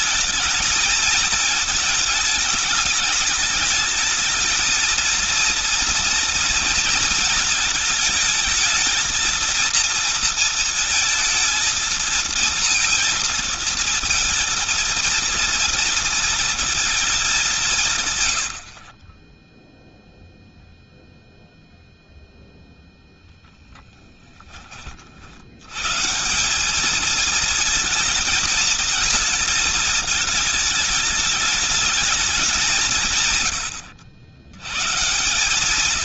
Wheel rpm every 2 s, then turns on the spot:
220, 210, 220, 230, 220, 230, 230, 230, 230, 70, 0, 0, 20, 190, 230, 220, 190, 120.
none